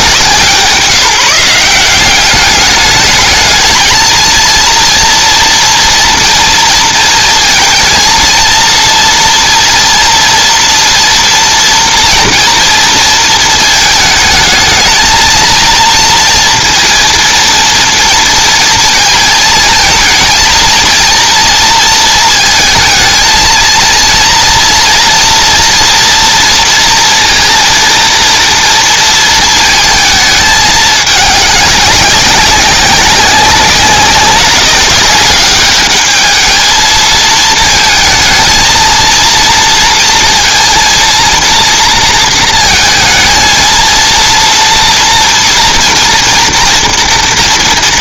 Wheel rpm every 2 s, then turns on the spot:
180, 210, 230, 230, 230, 240, 230, 220, 230, 220, 230, 230, 230, 230, 230, 210, 190, 200, 220, 220, 230, 230, 230, 230.
none